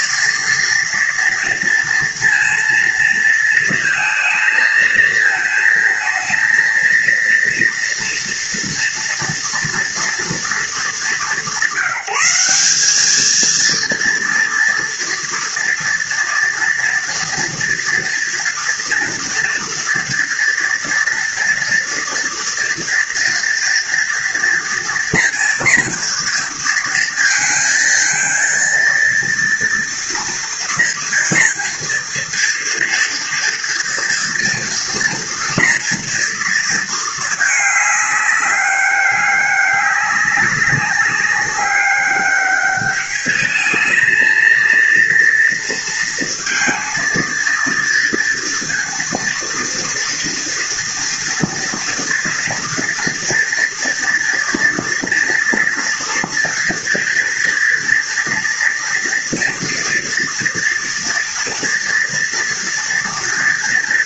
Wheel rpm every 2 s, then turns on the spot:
230, 230, 220, 230, 230, 200, 220, 230, 230, 240, 230, 230, 240, 230, 230, 230, 230, 230, 220, 200, 190, 210, 230, 230, 230, 230, 230, 230, 230, 230, 230, 230.
none